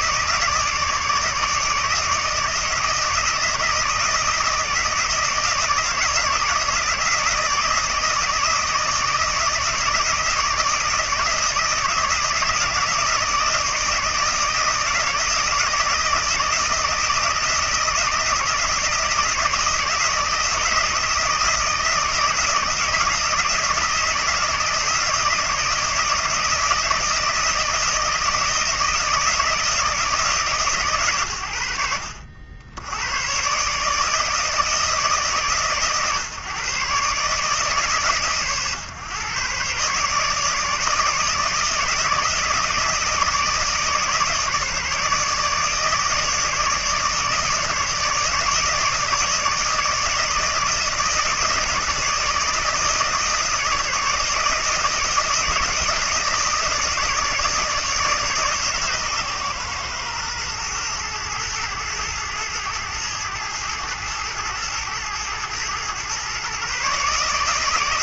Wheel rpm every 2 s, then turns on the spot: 150, 160, 160, 160, 160, 160, 160, 160, 160, 160, 160, 160, 160, 160, 160, 120, 90, 160, 140, 140, 150, 160, 150, 150, 160, 160, 160, 160, 160, 140, 110, 110, 110, 140.
none